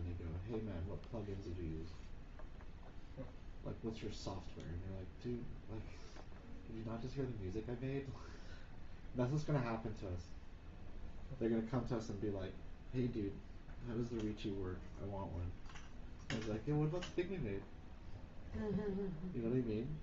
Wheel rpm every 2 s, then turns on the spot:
0, 0, 0, 0, 0, 0, 0, 0, 0, 0.
none